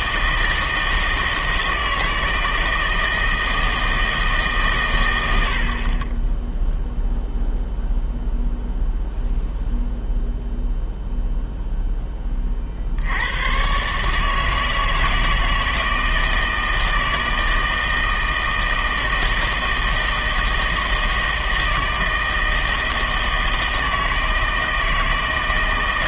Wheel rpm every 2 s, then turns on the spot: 160, 160, 140, 0, 0, 0, 30, 160, 160, 160, 160, 160, 160.
none